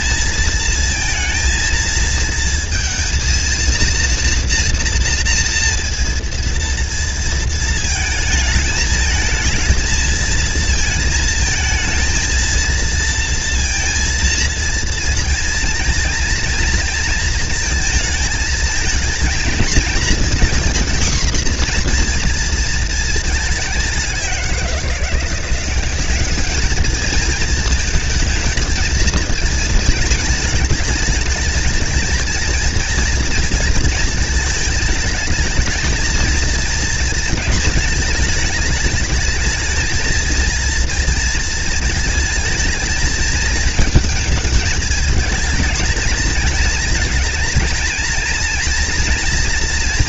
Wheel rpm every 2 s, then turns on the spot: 230, 230, 240, 230, 220, 230, 230, 230, 230, 220, 240, 220, 170, 220, 230, 220, 240, 220, 220, 210, 230, 220, 220, 230, 230.
none